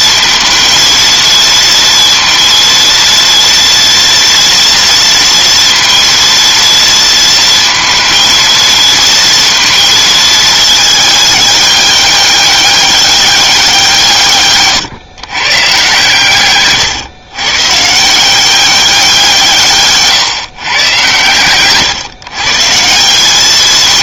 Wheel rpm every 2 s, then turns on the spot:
220, 230, 230, 230, 230, 210, 200, 130, 130, 190, 120, 180.
none